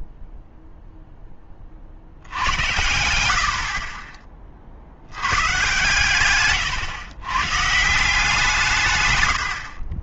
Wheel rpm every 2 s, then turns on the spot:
0, 90, 40, 130, 160.
6-8